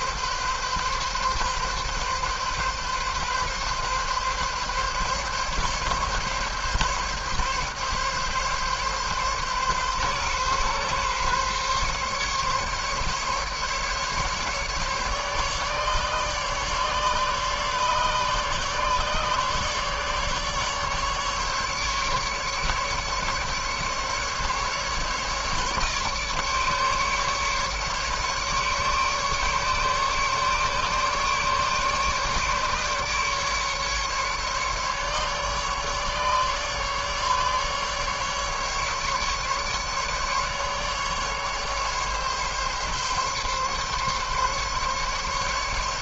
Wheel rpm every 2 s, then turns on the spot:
130, 140, 140, 140, 140, 140, 140, 140, 140, 140, 150, 150, 150, 150, 140, 150, 140, 140, 150, 140, 150, 140, 140.
none